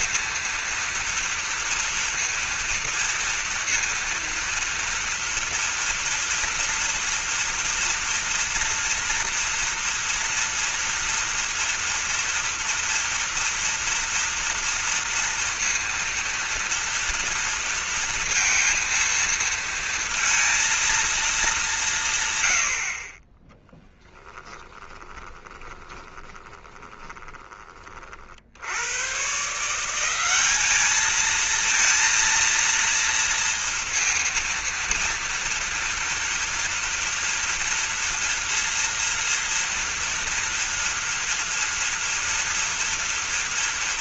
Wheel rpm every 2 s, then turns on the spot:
230, 230, 230, 230, 230, 240, 230, 240, 230, 230, 230, 60, 20, 20, 80, 210, 230, 230, 230, 230, 230, 230.
24-28